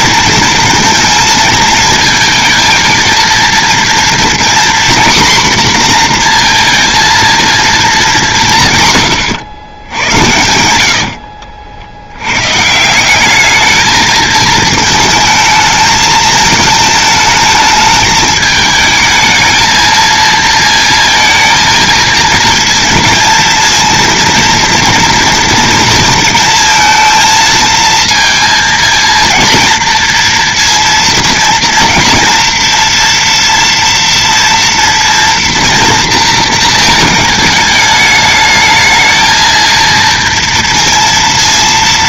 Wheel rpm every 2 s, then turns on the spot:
230, 230, 250, 230, 130, 80, 160, 220, 220, 210, 230, 230, 230, 230, 230, 230, 230, 230, 220, 220, 230.
10-12